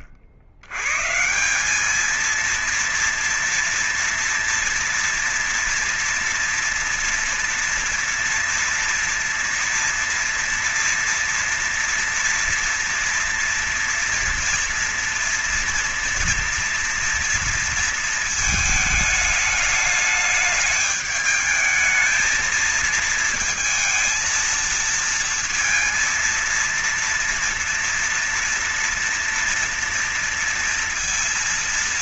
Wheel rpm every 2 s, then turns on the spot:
70, 220, 230, 230, 240, 230, 230, 240, 230, 220, 210, 220, 230, 230, 230, 230.
none